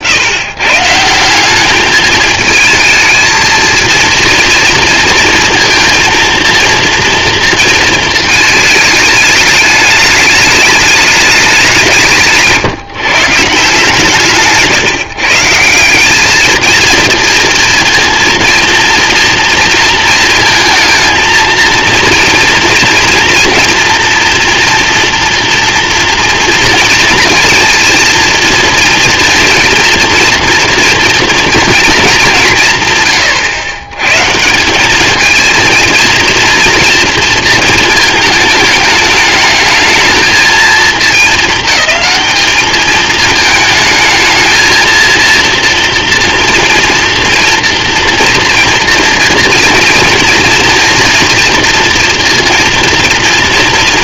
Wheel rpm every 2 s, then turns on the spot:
130, 220, 230, 230, 220, 210, 160, 140, 220, 230, 230, 240, 240, 240, 240, 230, 150, 180, 230, 210, 220, 210, 230, 230, 230, 230, 230.
none